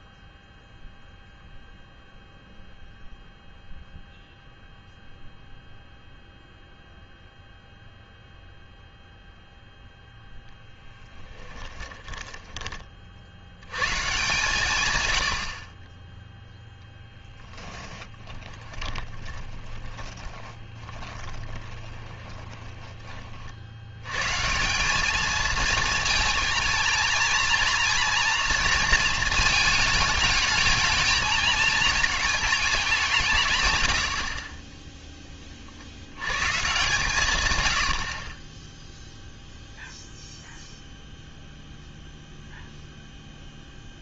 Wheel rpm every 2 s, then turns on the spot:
0, 0, 0, 0, 0, 10, 20, 140, 0, 20, 20, 20, 180, 230, 230, 220, 200, 20, 130, 10, 0, 0.
10-12 18-24